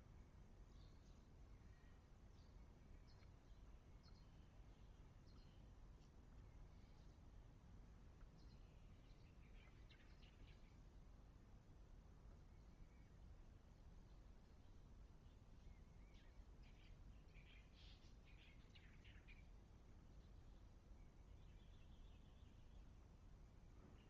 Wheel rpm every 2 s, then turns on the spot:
0, 0, 0, 0, 0, 0, 0, 0, 0, 0, 0, 0.
none